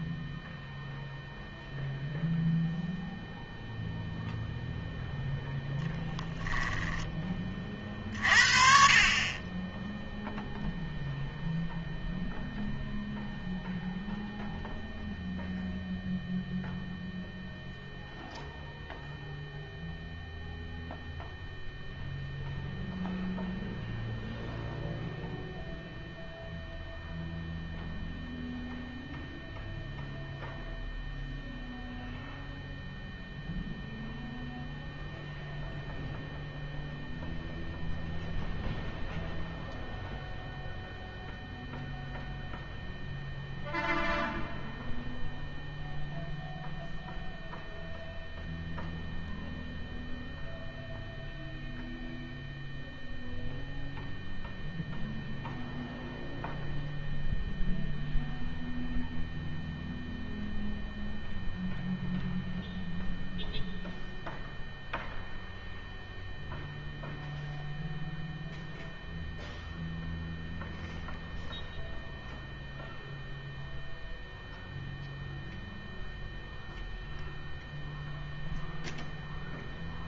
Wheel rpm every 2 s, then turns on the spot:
0, 0, 0, 10, 40, 0, 0, 0, 0, 0, 0, 0, 0, 0, 0, 0, 0, 0, 0, 0, 0, 0, 0, 0, 0, 0, 0, 0, 0, 0, 0, 0, 0, 0, 0, 0, 0, 0, 0, 0.
none